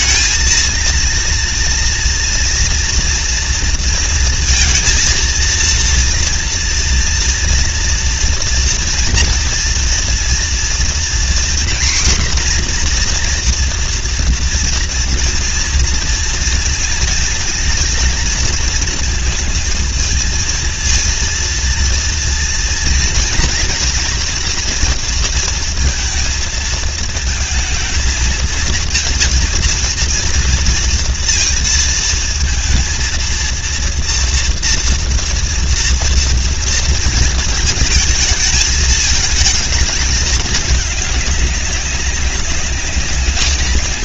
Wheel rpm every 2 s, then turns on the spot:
220, 240, 230, 230, 240, 240, 250, 230, 220, 220, 230, 230, 240, 230, 230, 230, 230, 230, 230, 230, 210, 190.
none